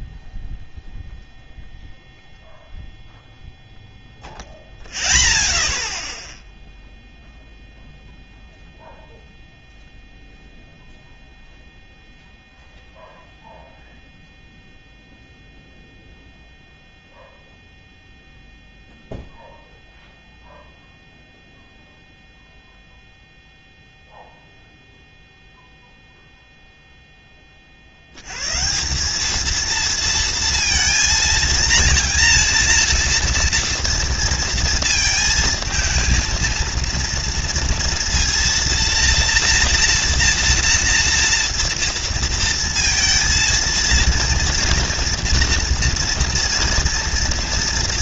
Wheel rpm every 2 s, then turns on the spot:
0, 0, 0, 0, 0, 0, 0, 0, 0, 0, 0, 0, 0, 0, 100, 230, 230, 230, 230, 230, 230, 230, 230, 230.
none